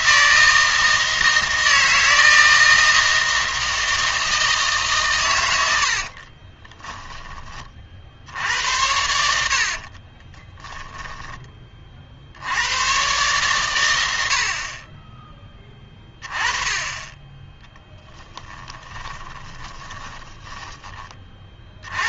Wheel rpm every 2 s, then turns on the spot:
160, 160, 150, 20, 80, 10, 80, 40, 20, 10, 10.
6-8 10-12 18-20